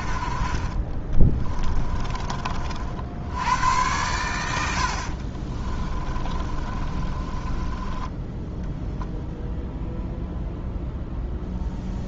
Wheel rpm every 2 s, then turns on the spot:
40, 60, 70, 30, 0, 0.
0-2 4-8